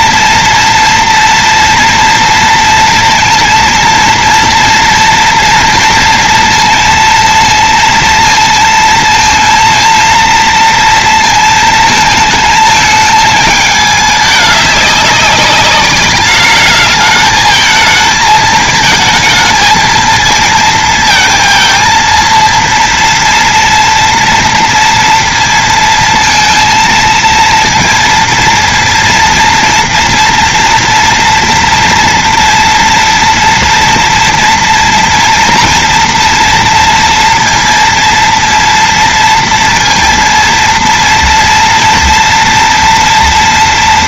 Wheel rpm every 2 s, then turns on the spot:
230, 230, 230, 230, 230, 230, 220, 200, 210, 220, 230, 230, 230, 230, 230, 230, 230, 240, 230, 230, 230, 230.
none